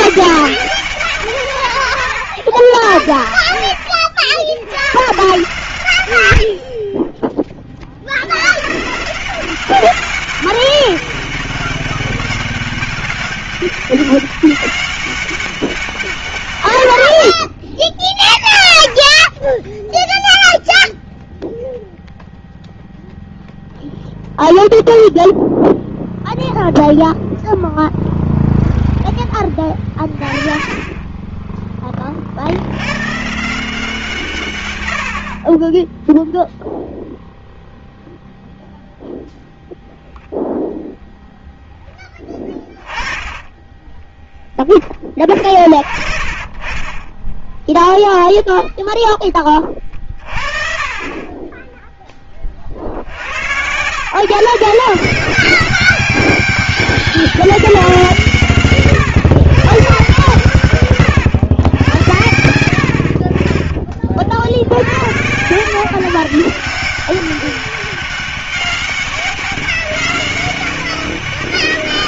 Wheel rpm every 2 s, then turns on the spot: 190, 70, 90, 50, 120, 200, 200, 200, 130, 20, 0, 0, 0, 0, 0, 30, 70, 120, 0, 0, 0, 20, 10, 30, 0, 40, 50, 160, 200, 160, 140, 80, 70, 170, 200, 200.
42-44 46-48